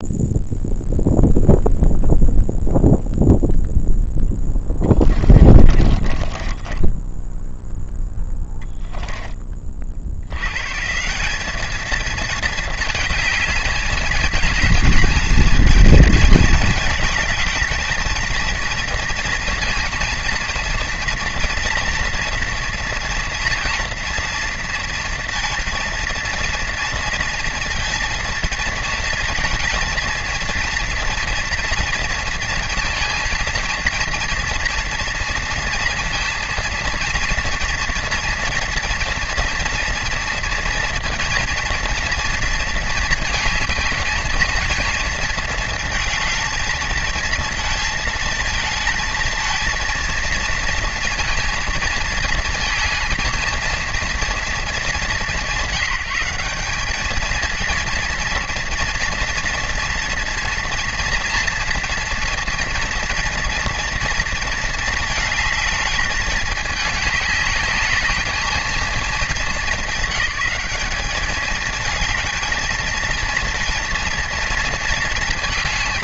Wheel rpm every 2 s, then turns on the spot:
0, 0, 10, 10, 10, 120, 220, 220, 220, 230, 230, 230, 230, 230, 220, 230, 230, 230, 230, 240, 230, 230, 230, 220, 220, 230, 230, 220, 210, 230, 230, 240, 220, 210, 220, 200, 220, 230.
4-8